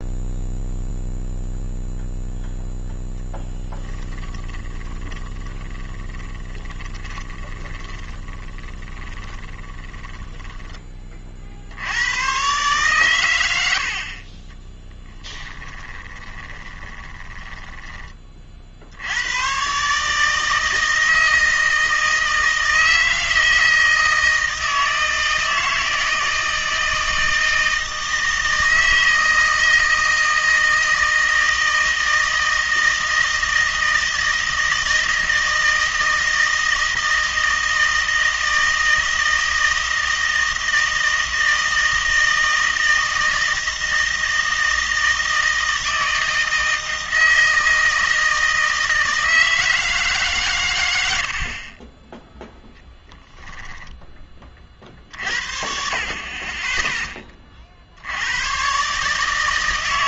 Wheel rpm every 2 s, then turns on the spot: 0, 0, 20, 20, 30, 20, 130, 20, 20, 60, 160, 160, 160, 160, 160, 160, 160, 160, 160, 160, 160, 160, 160, 160, 160, 120, 0, 40, 20, 120.
4-10 14-18